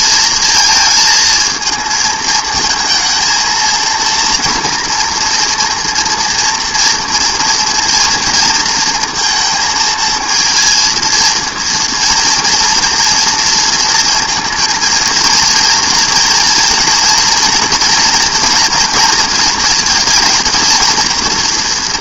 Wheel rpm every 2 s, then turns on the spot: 220, 230, 230, 230, 230, 230, 230, 220, 230, 230, 230.
none